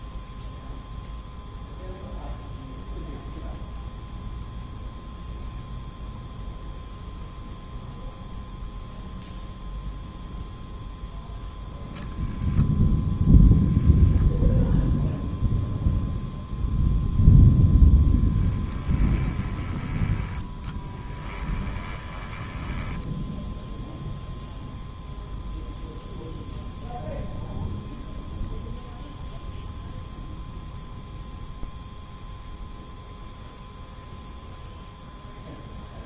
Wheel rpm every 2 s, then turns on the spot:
0, 0, 0, 0, 0, 0, 0, 0, 0, 10, 10, 10, 0, 0, 0, 0, 0, 0.
18-20 22-24